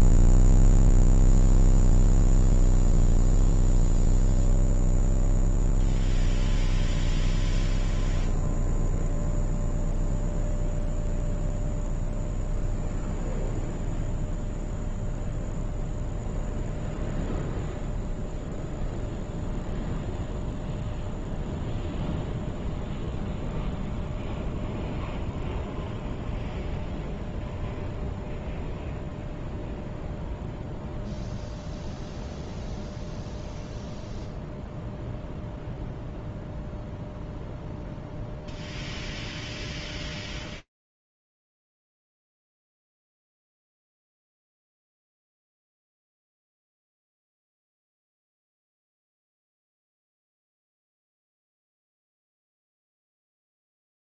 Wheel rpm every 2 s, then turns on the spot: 0, 0, 0, 0, 0, 0, 0, 0, 0, 0, 0, 0, 0, 0, 0, 0, 0, 0, 0, 0, 0, 0, 20, 20, 20, 10, 0.
none